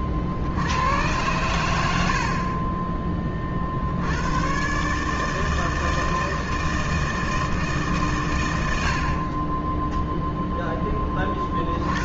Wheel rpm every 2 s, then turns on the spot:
60, 20, 110, 160, 120, 0.
none